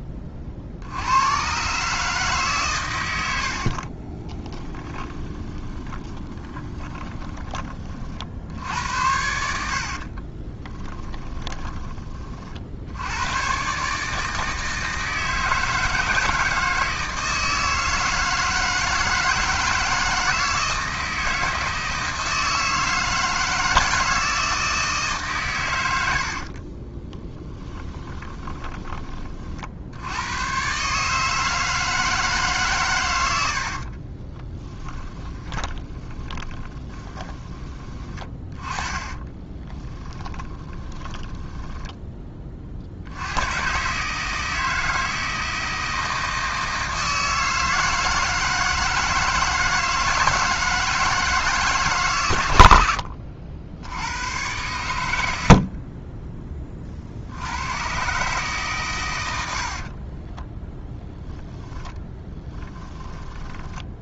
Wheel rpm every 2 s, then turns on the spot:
40, 130, 20, 20, 70, 20, 70, 160, 160, 160, 160, 160, 160, 40, 20, 120, 130, 10, 10, 20, 10, 50, 160, 160, 160, 160, 90, 110, 30, 140, 0, 10.
4-8 10-12 26-30 34-42 62-64